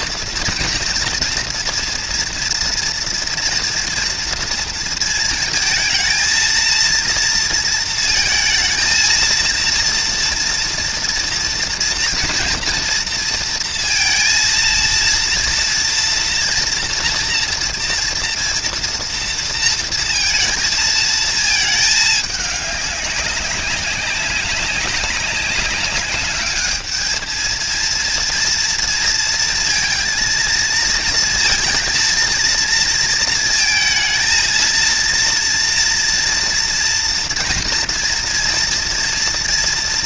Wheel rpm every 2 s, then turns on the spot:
230, 230, 230, 230, 220, 230, 230, 230, 230, 230, 230, 200, 200, 210, 230, 230, 230, 230, 240, 230.
none